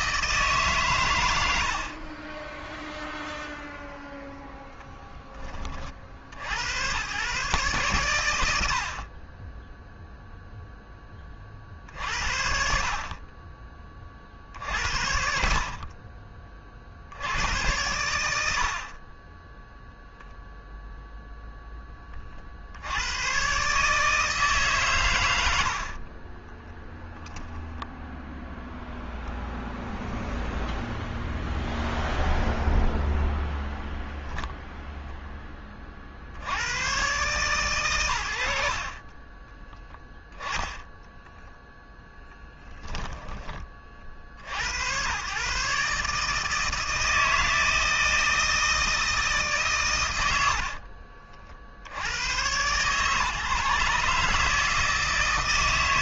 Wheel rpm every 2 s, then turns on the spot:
140, 10, 0, 100, 70, 10, 50, 70, 70, 50, 0, 80, 150, 10, 0, 0, 0, 0, 90, 80, 20, 10, 90, 160, 160, 40, 120, 160.
26-28 50-52